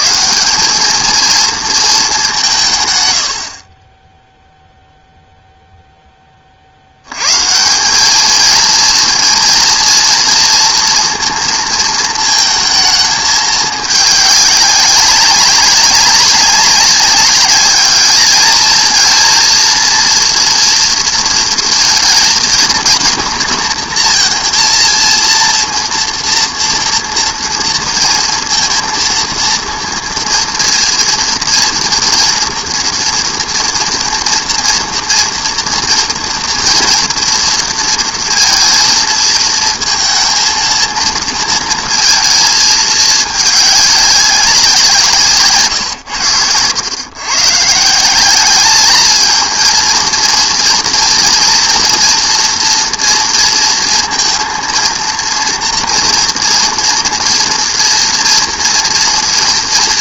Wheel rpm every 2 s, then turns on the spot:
210, 150, 0, 80, 220, 230, 220, 200, 200, 220, 230, 230, 230, 230, 230, 240, 240, 240, 230, 230, 230, 220, 170, 100, 210, 230, 230, 230, 230, 230.
none